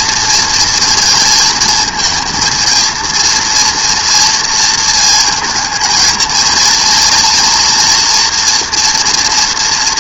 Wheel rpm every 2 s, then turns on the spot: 230, 230, 230, 230, 240.
none